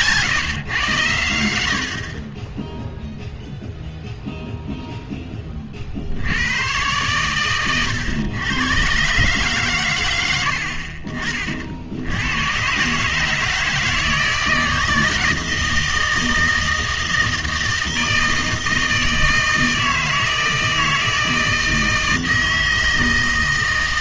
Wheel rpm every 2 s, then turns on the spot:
130, 10, 0, 100, 110, 70, 110, 160, 160, 160, 160, 160.
none